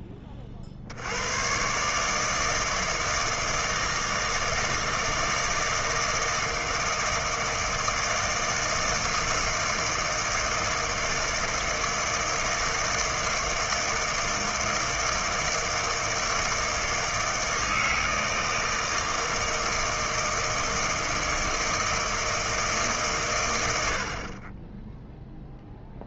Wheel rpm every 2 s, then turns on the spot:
50, 160, 160, 160, 160, 160, 160, 160, 160, 160, 160, 150, 30.
none